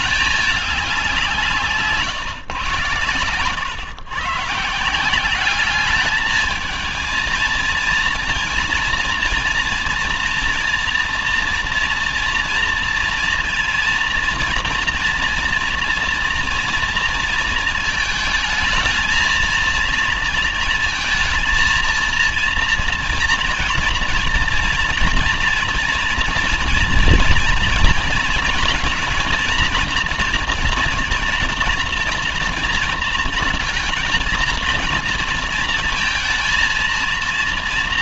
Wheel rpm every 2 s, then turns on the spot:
200, 140, 140, 220, 230, 230, 230, 230, 230, 220, 230, 230, 230, 230, 230, 230, 230, 230, 230.
none